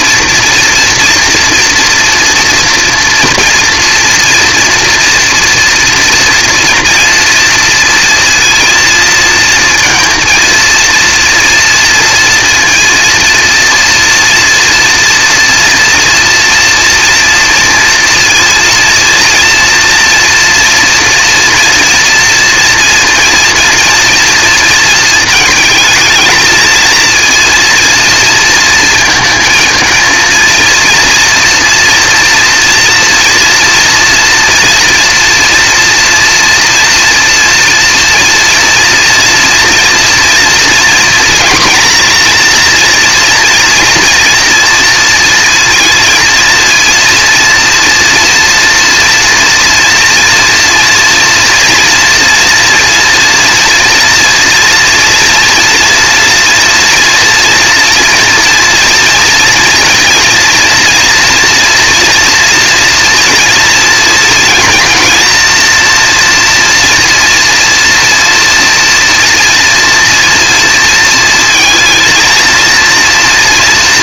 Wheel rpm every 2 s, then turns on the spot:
240, 230, 230, 230, 230, 230, 230, 230, 230, 230, 230, 230, 230, 220, 230, 230, 240, 230, 230, 230, 230, 240, 230, 230, 230, 230, 240, 230, 230, 230, 240, 230, 230, 230, 230, 230, 230.
none